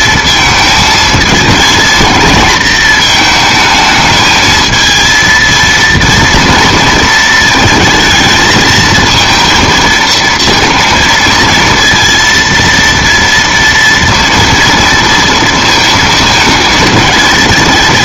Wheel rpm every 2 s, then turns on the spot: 220, 220, 220, 230, 230, 230, 230, 230, 220.
none